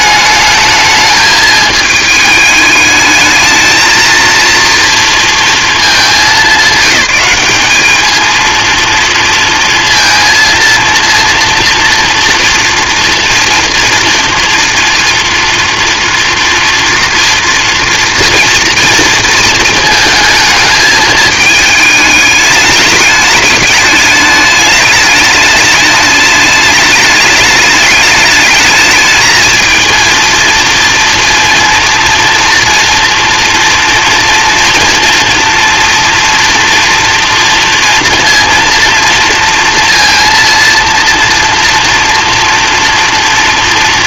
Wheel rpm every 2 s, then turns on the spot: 220, 220, 230, 200, 230, 230, 230, 230, 240, 230, 220, 210, 210, 210, 220, 230, 230, 240, 230, 230, 230, 230.
none